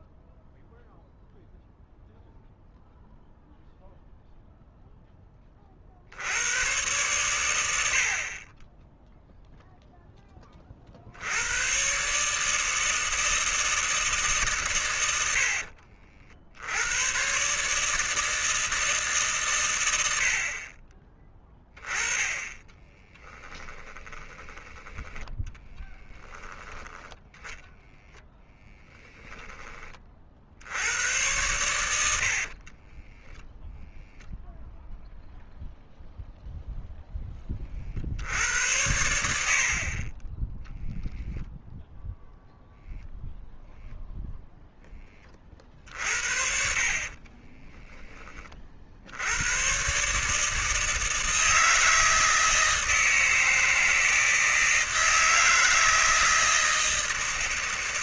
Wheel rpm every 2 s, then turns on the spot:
0, 0, 0, 100, 10, 40, 160, 130, 80, 160, 40, 10, 20, 10, 20, 80, 40, 0, 0, 80, 10, 0, 10, 60, 40, 160, 160, 160, 160.
22-24 28-30 32-34 46-48